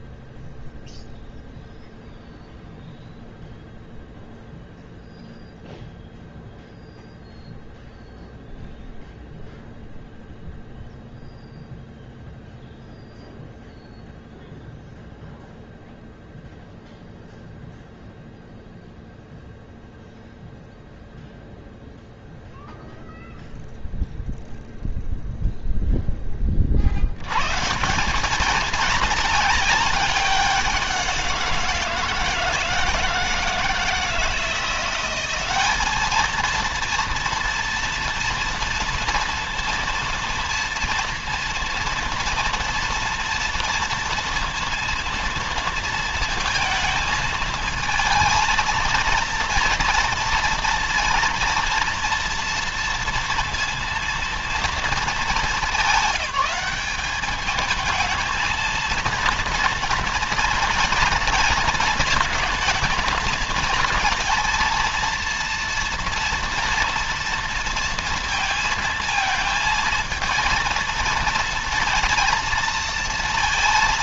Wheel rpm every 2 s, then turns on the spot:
0, 0, 0, 0, 0, 0, 0, 0, 0, 0, 0, 0, 0, 40, 220, 180, 160, 180, 230, 230, 230, 230, 230, 230, 230, 230, 230, 220, 190, 230, 230, 220, 230, 230, 220, 230, 230.
none